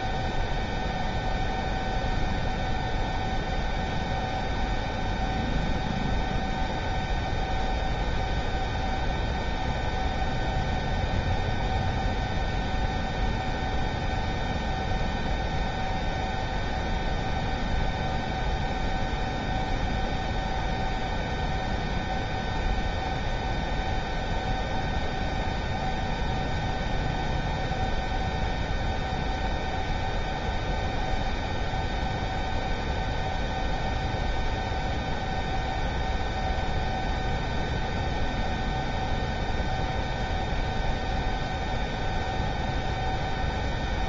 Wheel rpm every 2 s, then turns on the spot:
0, 0, 0, 0, 0, 0, 0, 0, 0, 0, 0, 0, 0, 0, 0, 0, 0, 0, 0, 0, 0, 0.
none